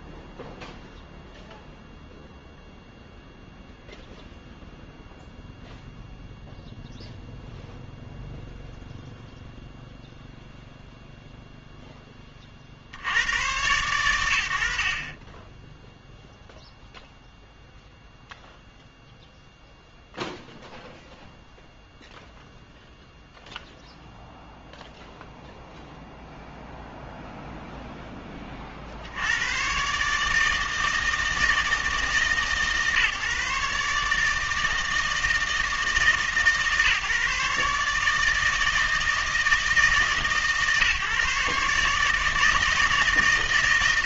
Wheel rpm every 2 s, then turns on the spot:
0, 0, 0, 0, 0, 0, 70, 70, 0, 0, 0, 0, 0, 0, 40, 160, 150, 160, 150, 160, 150, 160.
none